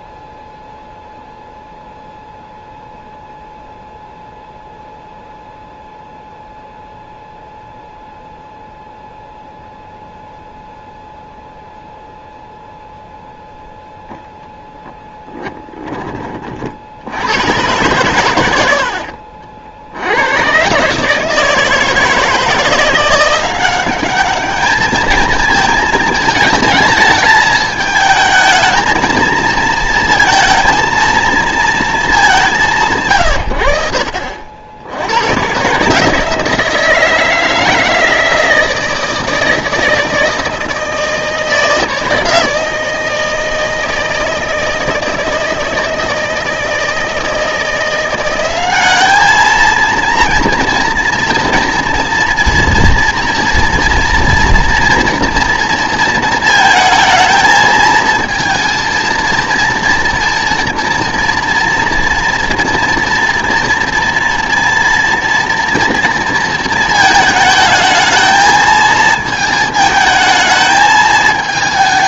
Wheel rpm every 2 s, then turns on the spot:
0, 0, 0, 0, 0, 0, 0, 0, 50, 100, 130, 160, 210, 220, 220, 230, 170, 60, 160, 160, 160, 160, 160, 160, 190, 230, 230, 230, 220, 230, 240, 230, 230, 230, 220, 220.
none